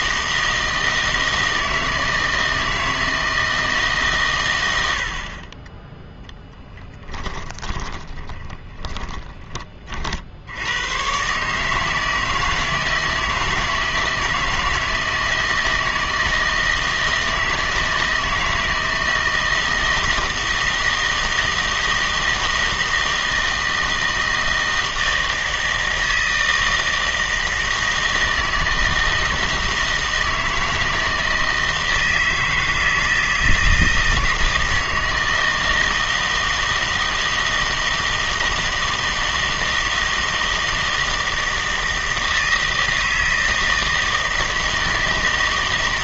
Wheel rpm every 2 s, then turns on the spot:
160, 160, 80, 10, 10, 100, 160, 160, 160, 160, 160, 160, 160, 160, 160, 160, 160, 160, 160, 160, 160, 160, 160.
6-10